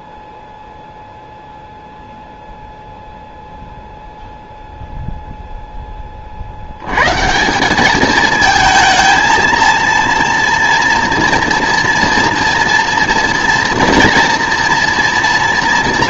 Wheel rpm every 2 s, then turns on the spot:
0, 0, 0, 80, 220, 230, 230, 230.
none